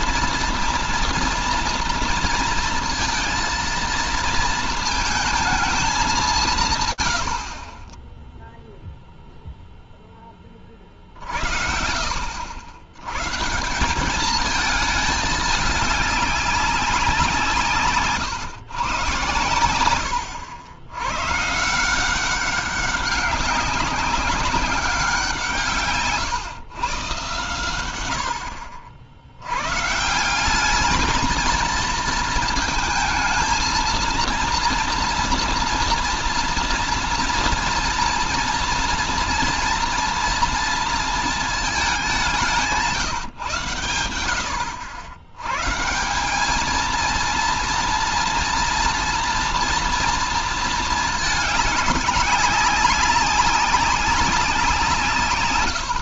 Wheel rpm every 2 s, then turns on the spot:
230, 230, 230, 120, 0, 40, 100, 210, 190, 120, 100, 190, 190, 130, 70, 210, 230, 230, 230, 230, 230, 150, 100, 230, 230, 220, 200, 150.
none